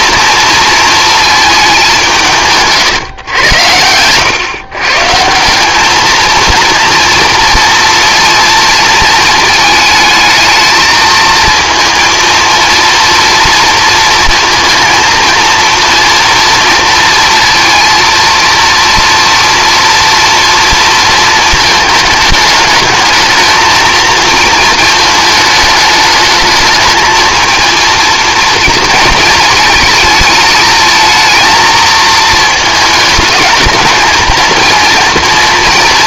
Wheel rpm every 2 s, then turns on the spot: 230, 150, 130, 230, 220, 220, 230, 230, 230, 230, 230, 210, 230, 220, 220, 220, 220, 230.
2-4